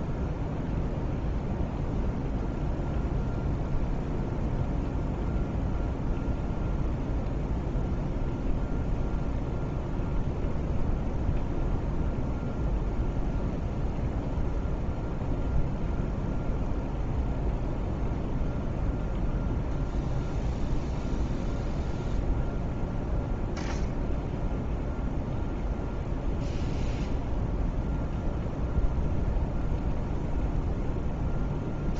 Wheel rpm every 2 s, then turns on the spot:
0, 0, 0, 0, 0, 0, 0, 0, 0, 0, 0, 0, 0, 0, 0, 0.
none